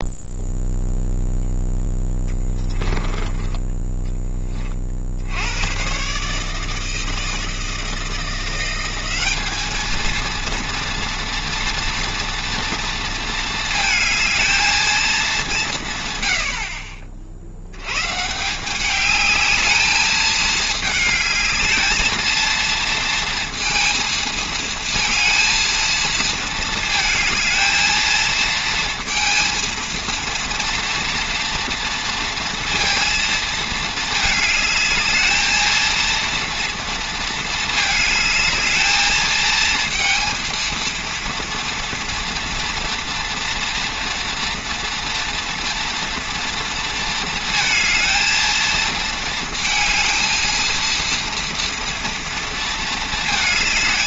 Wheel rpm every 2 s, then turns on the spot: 0, 10, 30, 160, 180, 230, 230, 220, 60, 180, 220, 230, 220, 220, 230, 230, 230, 220, 230, 220, 230, 230, 230, 230, 220, 230, 220.
none